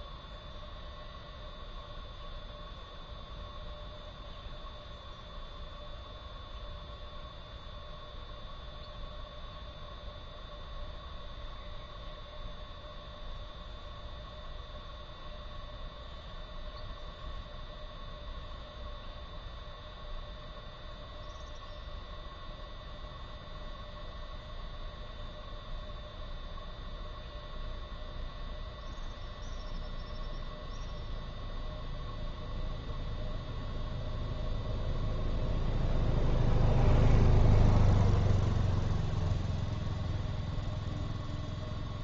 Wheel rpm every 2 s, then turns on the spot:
0, 0, 0, 0, 0, 0, 0, 0, 0, 0, 0, 0, 0, 0, 0, 0, 0, 0, 0, 0, 0.
none